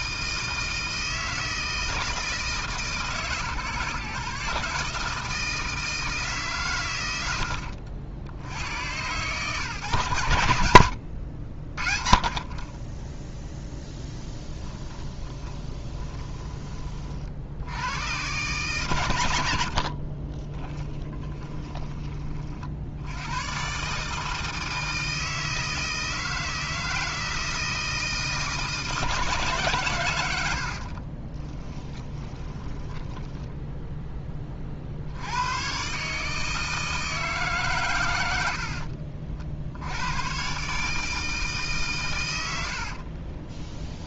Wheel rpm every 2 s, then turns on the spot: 160, 150, 140, 130, 120, 70, 20, 20, 20, 120, 20, 50, 160, 160, 160, 70, 20, 50, 160, 70, 130, 90.
14-16 20-22 30-34 38-40 42-44